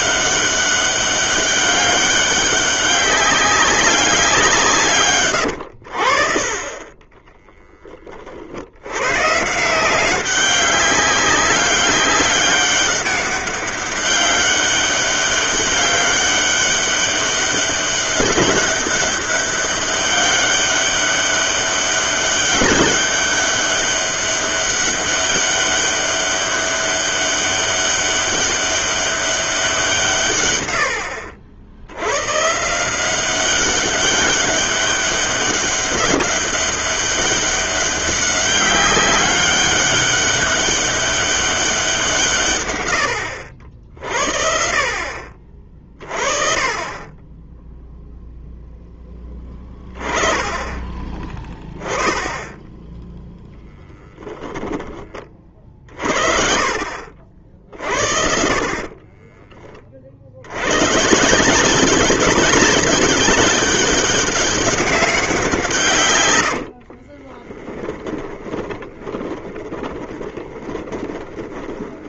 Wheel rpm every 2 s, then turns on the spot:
190, 200, 150, 30, 90, 190, 190, 200, 200, 200, 200, 200, 200, 200, 200, 80, 170, 200, 200, 190, 200, 100, 50, 20, 0, 20, 0, 10, 40, 40, 110, 200, 200, 60, 20, 20.
66-72